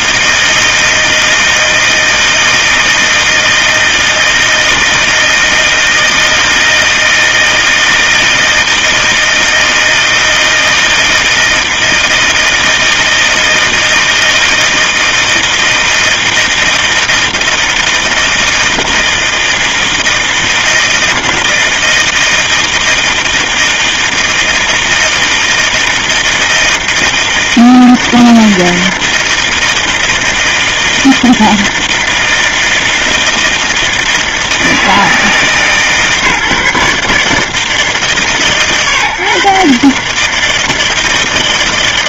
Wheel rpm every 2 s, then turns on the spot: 160, 160, 160, 160, 160, 160, 160, 160, 160, 160, 160, 160, 160, 160, 160, 160, 160, 150, 140, 160, 160.
none